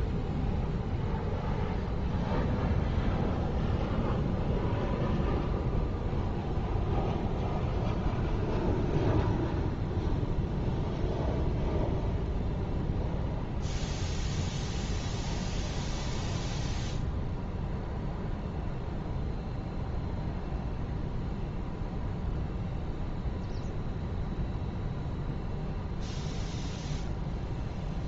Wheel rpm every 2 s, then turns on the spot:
0, 0, 0, 0, 0, 0, 0, 0, 0, 0, 0, 0, 0, 0.
none